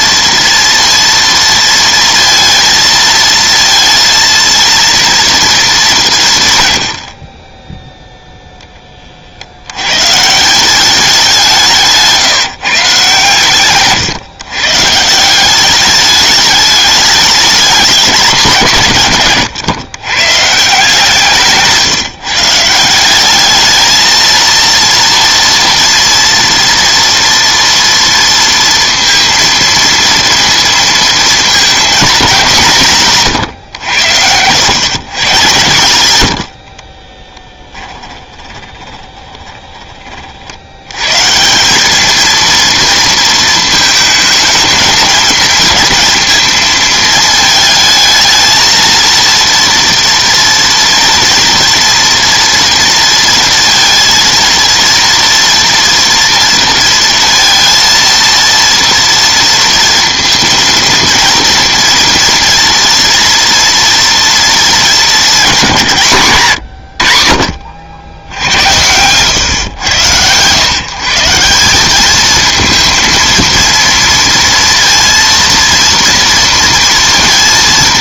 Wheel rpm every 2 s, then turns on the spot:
230, 220, 230, 120, 20, 180, 140, 140, 210, 150, 160, 170, 230, 230, 230, 230, 180, 120, 50, 20, 90, 230, 220, 230, 230, 230, 230, 230, 230, 230, 230, 230, 220, 120, 90, 130, 230, 230, 230.
36-40